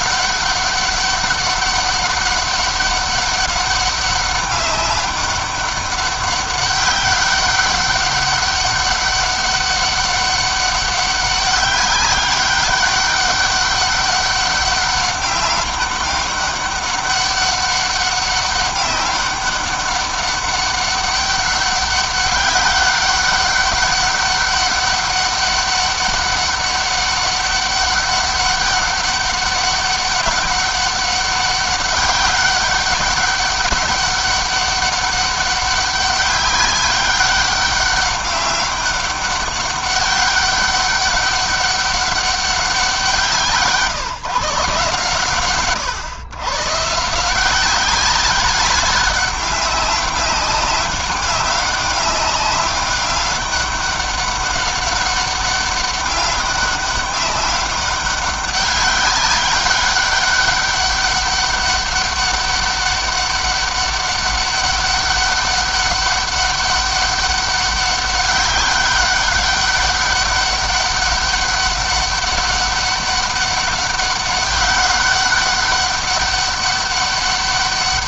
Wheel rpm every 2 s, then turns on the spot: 200, 200, 200, 200, 200, 200, 200, 200, 200, 200, 200, 200, 200, 200, 200, 200, 200, 200, 200, 200, 200, 180, 140, 150, 200, 200, 200, 200, 200, 200, 200, 200, 200, 200, 200, 200, 200, 200, 200.
none